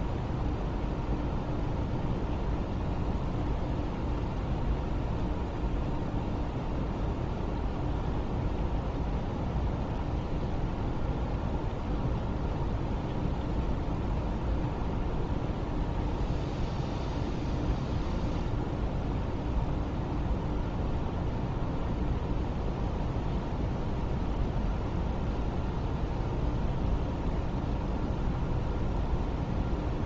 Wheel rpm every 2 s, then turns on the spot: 0, 0, 0, 0, 0, 0, 0, 0, 0, 0, 0, 0, 0, 0, 0.
none